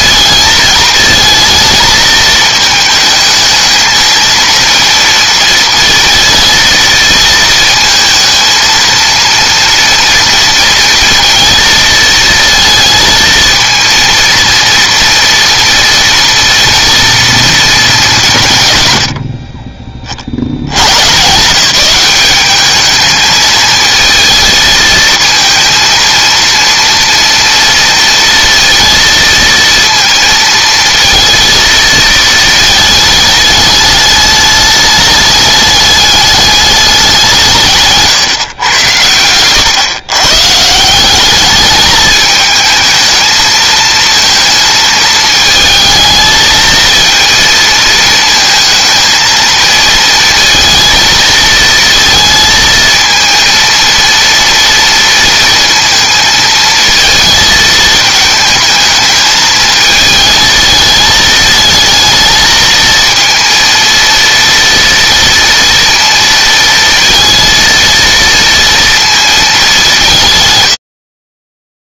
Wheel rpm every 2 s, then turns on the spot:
220, 220, 230, 230, 230, 230, 230, 230, 230, 100, 110, 210, 220, 230, 230, 230, 220, 210, 200, 110, 170, 220, 220, 220, 230, 230, 230, 230, 220, 220, 220, 220, 230, 230, 230, 90.
none